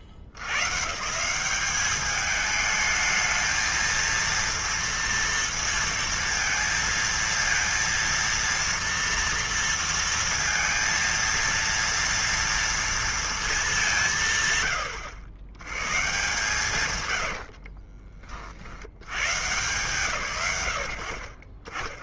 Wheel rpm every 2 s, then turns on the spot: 80, 210, 230, 230, 230, 230, 230, 130, 150, 50, 100.
none